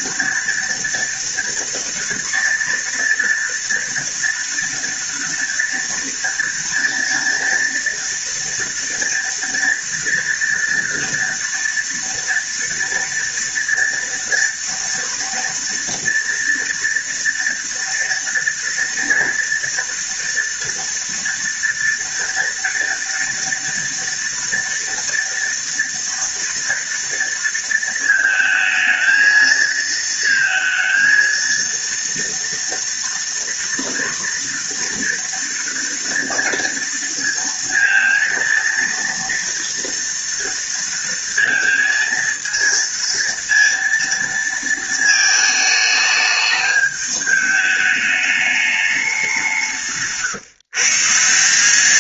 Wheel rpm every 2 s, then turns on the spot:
230, 230, 230, 230, 230, 230, 230, 230, 230, 230, 230, 230, 230, 230, 220, 230, 230, 230, 230, 230, 230, 230, 220, 210, 190, 160.
none